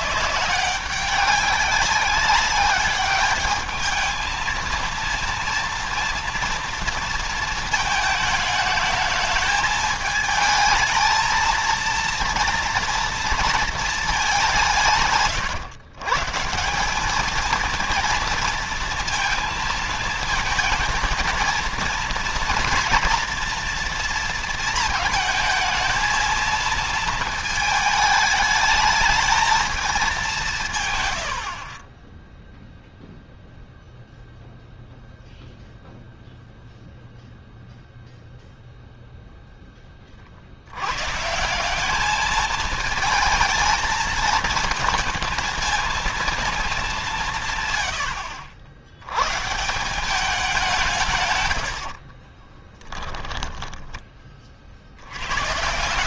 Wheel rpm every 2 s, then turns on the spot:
190, 200, 220, 230, 220, 220, 230, 180, 150, 230, 230, 230, 230, 220, 220, 180, 10, 0, 0, 0, 60, 220, 220, 220, 90, 200, 30, 40.
52-54